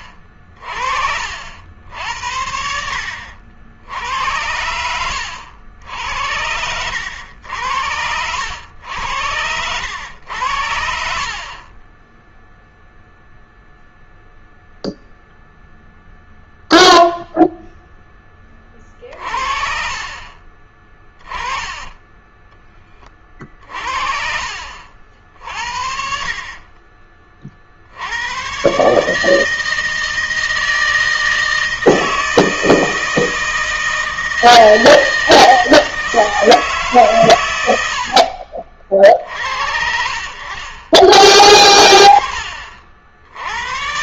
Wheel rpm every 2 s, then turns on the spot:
40, 60, 80, 80, 90, 80, 0, 0, 0, 20, 30, 20, 50, 40, 110, 160, 160, 160, 160, 50, 40, 50.
0-2 4-8 22-24